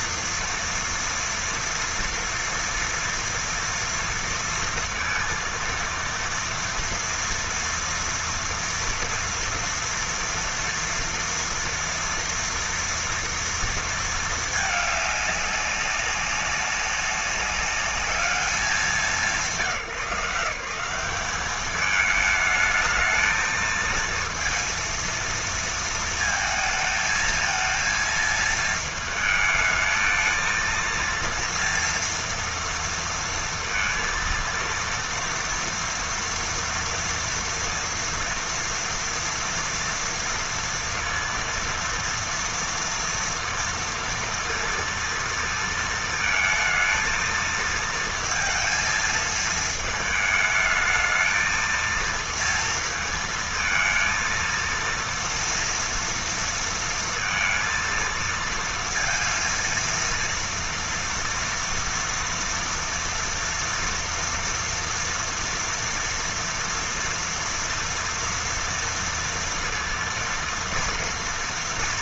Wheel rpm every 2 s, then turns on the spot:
230, 230, 230, 230, 230, 230, 230, 210, 200, 180, 180, 220, 230, 220, 220, 230, 230, 230, 230, 230, 230, 230, 230, 220, 220, 220, 230, 230, 230, 230, 230, 230, 230, 230, 230, 230.
none